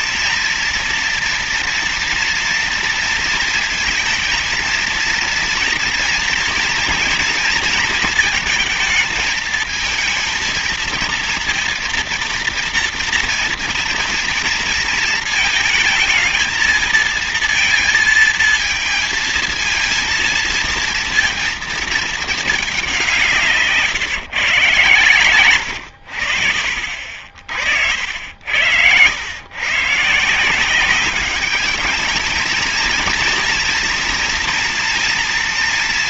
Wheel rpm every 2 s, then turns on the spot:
230, 230, 230, 230, 220, 230, 240, 230, 230, 230, 230, 200, 130, 60, 90, 180, 220, 230.
none